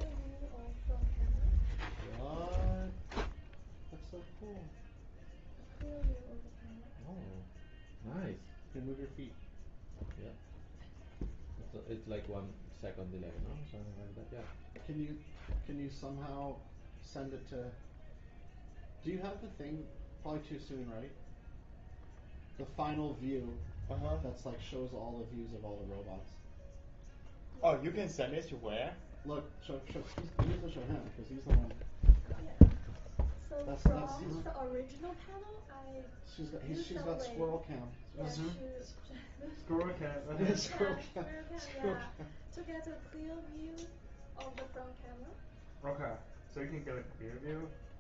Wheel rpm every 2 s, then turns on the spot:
0, 0, 0, 0, 0, 0, 0, 0, 0, 0, 0, 0, 0, 0, 0, 0, 0, 0, 0, 0, 0, 0, 0, 0.
none